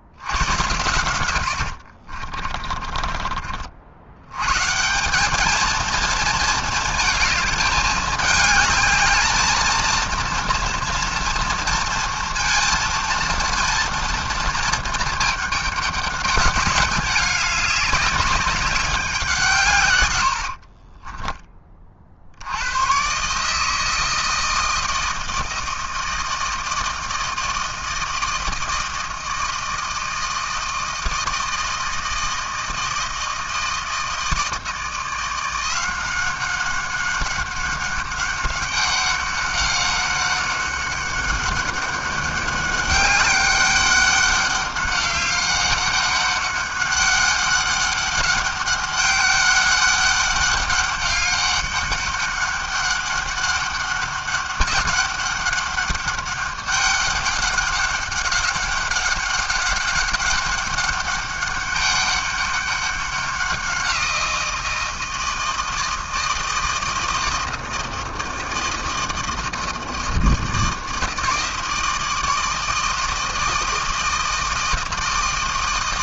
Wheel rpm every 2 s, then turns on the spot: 110, 40, 200, 220, 220, 230, 230, 210, 200, 180, 20, 140, 160, 160, 160, 160, 160, 170, 190, 200, 200, 200, 200, 200, 200, 200, 200, 200, 200, 200, 200, 190, 160, 160, 160, 160, 160, 160.
0-4 20-22